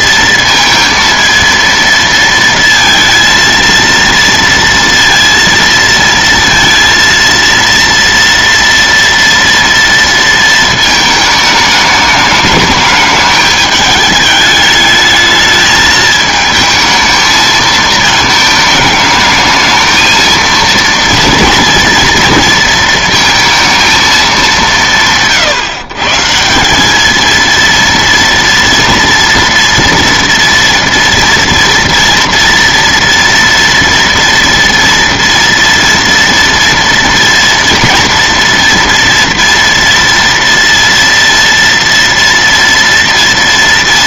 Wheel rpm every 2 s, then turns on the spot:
230, 230, 230, 230, 230, 220, 210, 210, 220, 220, 230, 230, 170, 180, 230, 230, 230, 240, 230, 240, 230, 230.
none